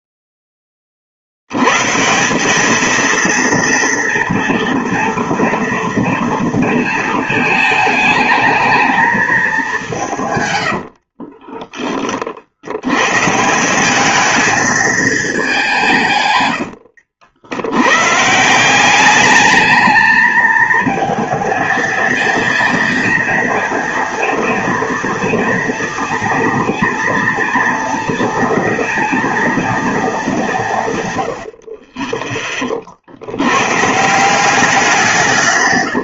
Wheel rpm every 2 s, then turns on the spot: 20, 210, 230, 230, 220, 110, 80, 220, 100, 180, 220, 230, 230, 220, 230, 160, 30, 180.
10-12 16-18